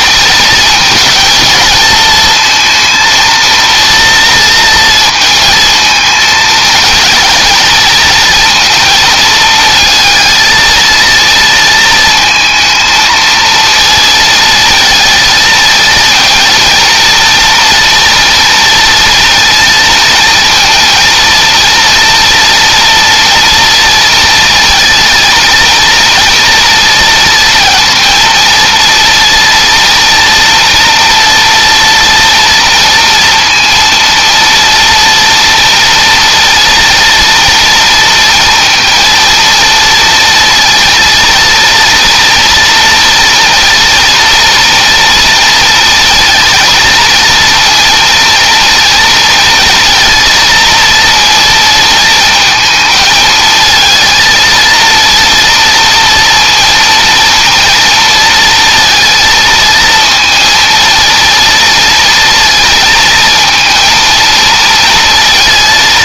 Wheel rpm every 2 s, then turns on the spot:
220, 230, 230, 230, 220, 230, 220, 230, 230, 230, 230, 230, 220, 230, 230, 240, 230, 230, 230, 230, 230, 240, 230, 230, 230, 230, 220, 230, 230, 230, 230, 230, 230.
none